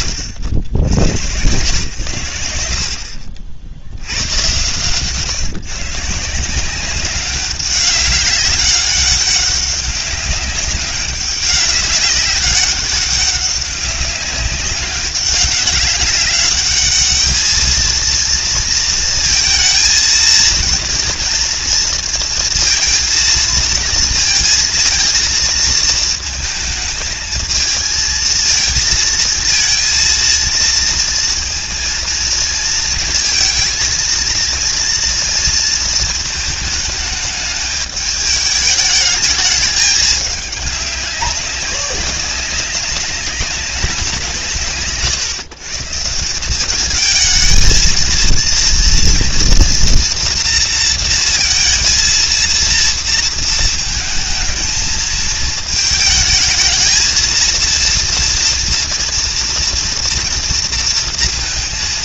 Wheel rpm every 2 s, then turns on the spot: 90, 80, 130, 190, 200, 200, 200, 200, 200, 230, 230, 230, 230, 220, 220, 230, 230, 230, 220, 210, 200, 190, 150, 190, 230, 230, 230, 220, 220, 230, 230.
none